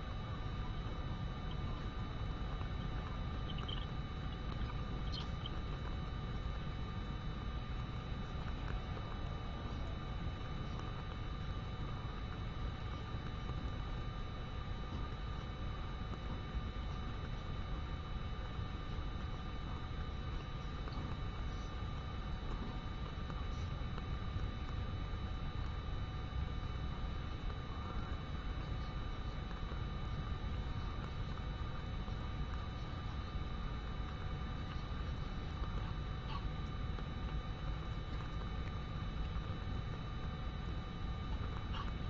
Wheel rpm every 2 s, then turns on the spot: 0, 0, 0, 0, 0, 0, 0, 0, 0, 0, 0, 0, 0, 0, 0, 0, 0, 0, 0, 0, 0.
none